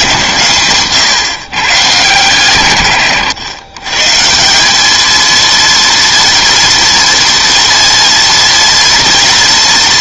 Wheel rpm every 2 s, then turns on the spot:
130, 130, 180, 230, 230.
none